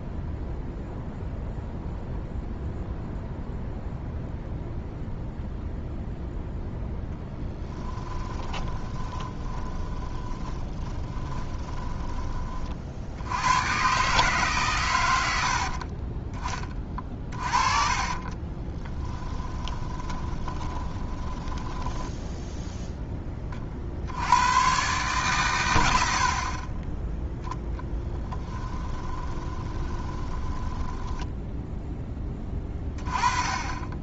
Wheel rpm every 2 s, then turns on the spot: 0, 0, 0, 0, 30, 20, 50, 120, 20, 20, 20, 0, 120, 20, 20, 10, 20.
8-12 18-22 28-32